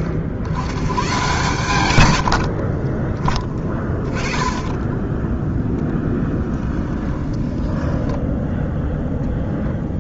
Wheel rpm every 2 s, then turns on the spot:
70, 50, 10, 10, 10.
2-8